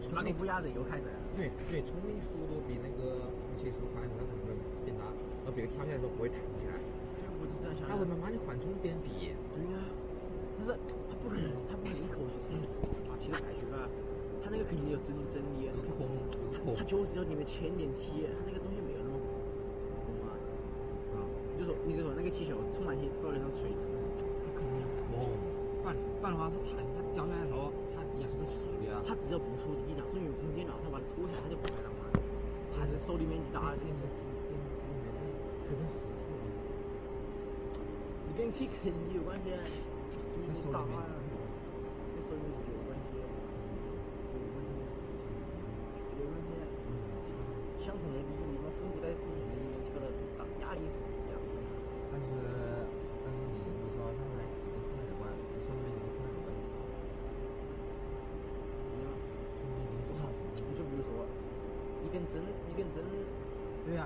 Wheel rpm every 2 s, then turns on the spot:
0, 0, 0, 0, 0, 0, 0, 0, 0, 0, 0, 0, 0, 0, 0, 0, 0, 0, 0, 0, 0, 0, 0, 0, 0, 0, 0, 0, 0, 0, 0, 0.
none